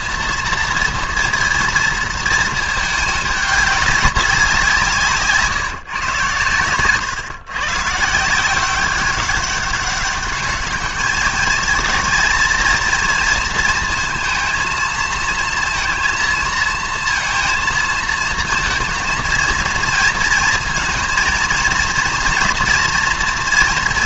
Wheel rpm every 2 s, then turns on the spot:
230, 220, 170, 120, 180, 210, 230, 230, 230, 220, 230, 230.
none